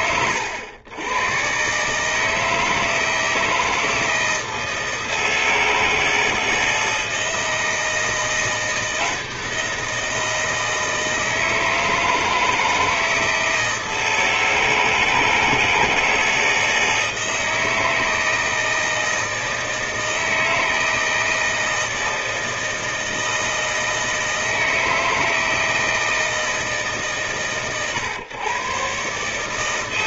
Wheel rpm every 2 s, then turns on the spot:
100, 160, 160, 160, 170, 160, 160, 160, 160, 160, 160, 160, 160, 150, 140.
none